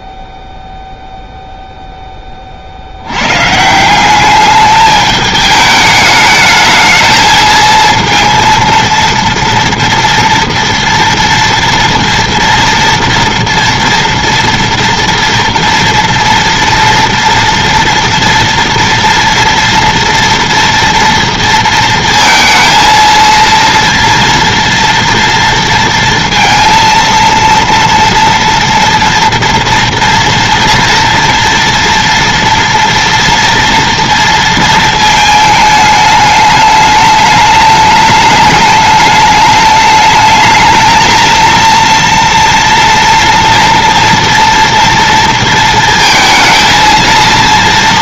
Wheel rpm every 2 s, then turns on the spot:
0, 50, 210, 220, 230, 230, 230, 230, 230, 230, 230, 230, 240, 230, 230, 230, 230, 230, 210, 210, 220, 230, 230, 220.
none